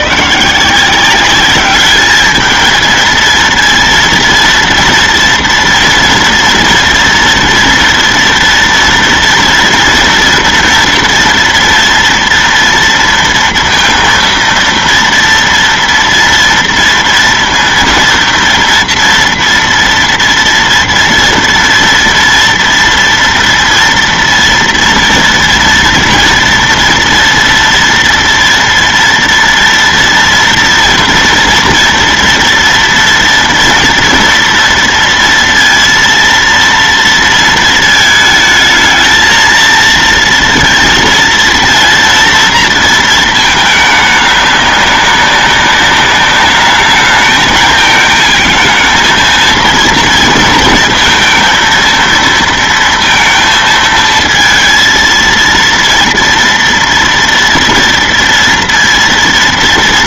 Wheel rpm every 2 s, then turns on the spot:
160, 220, 230, 230, 230, 230, 230, 230, 230, 230, 230, 230, 230, 230, 230, 230, 230, 230, 230, 220, 230, 230, 200, 210, 220, 230, 230, 230, 230, 230.
none